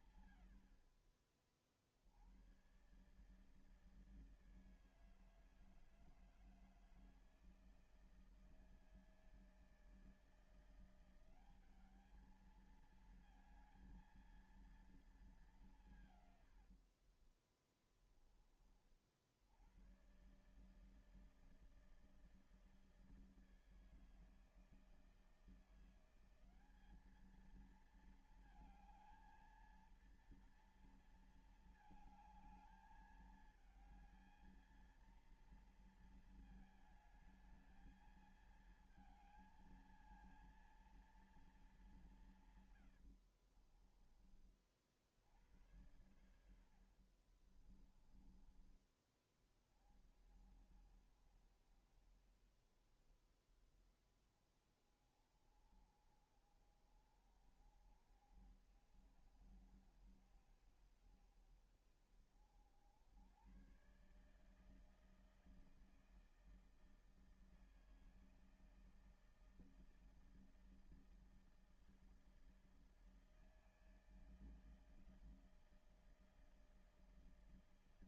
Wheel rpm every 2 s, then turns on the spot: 120, 80, 160, 160, 160, 160, 210, 230, 120, 20, 120, 160, 160, 180, 220, 230, 220, 220, 230, 220, 230, 170, 30, 80, 20, 40, 40, 20, 40, 60, 60, 60, 140, 160, 160, 160, 160, 160, 160.
16-18 46-48